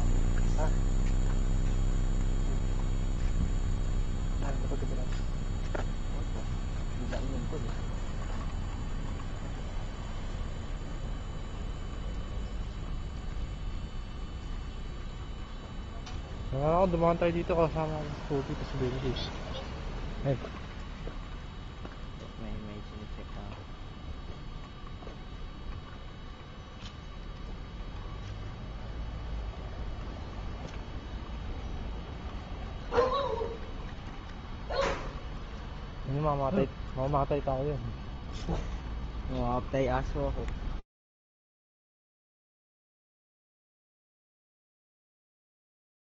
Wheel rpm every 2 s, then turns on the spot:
0, 0, 0, 0, 0, 0, 0, 0, 0, 0, 0, 0, 0, 0, 0, 0, 0, 0, 0, 0, 0, 0, 0.
none